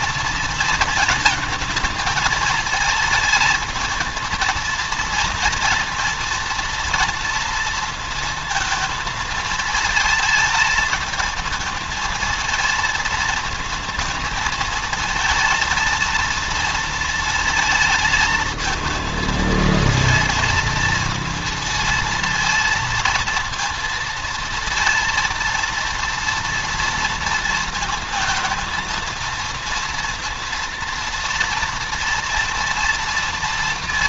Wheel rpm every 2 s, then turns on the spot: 220, 220, 230, 230, 220, 220, 230, 230, 230, 220, 230, 230, 230, 230, 230, 230, 230.
none